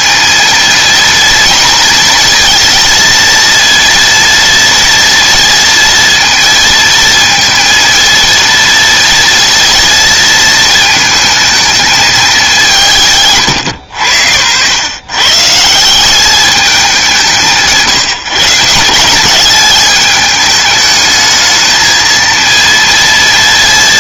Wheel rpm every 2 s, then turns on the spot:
230, 230, 230, 230, 230, 220, 210, 100, 210, 160, 210, 230.
none